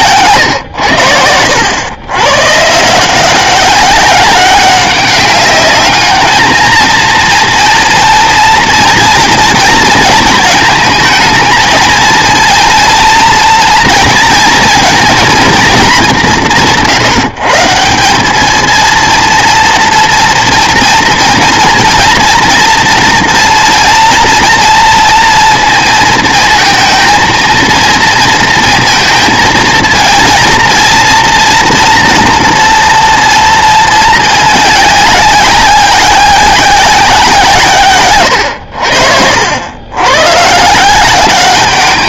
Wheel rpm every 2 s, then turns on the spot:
90, 170, 200, 230, 230, 230, 230, 230, 160, 230, 230, 230, 230, 230, 220, 230, 230, 200, 180, 70, 180.
none